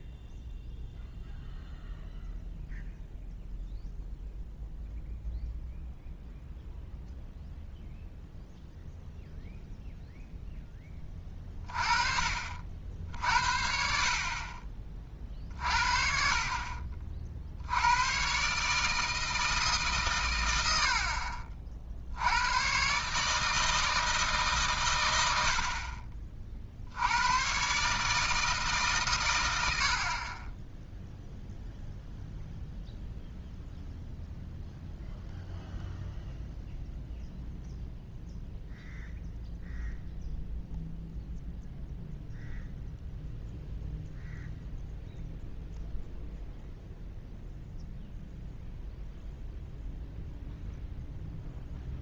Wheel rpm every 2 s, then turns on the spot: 0, 0, 0, 0, 0, 10, 60, 40, 40, 150, 90, 120, 130, 50, 150, 10, 0, 0, 0, 0, 0, 0, 0, 0, 0, 0.
none